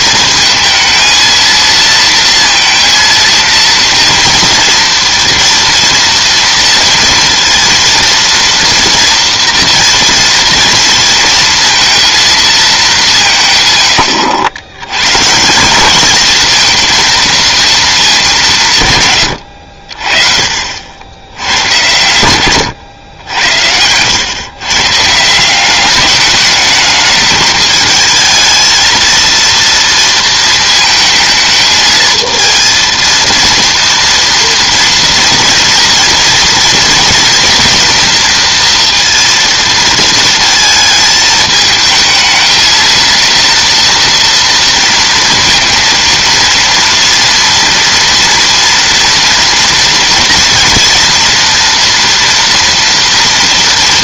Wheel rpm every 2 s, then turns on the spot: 220, 230, 230, 230, 230, 230, 190, 120, 230, 140, 70, 110, 140, 210, 220, 220, 230, 230, 230, 230, 220, 230, 230, 230, 230, 240, 230.
none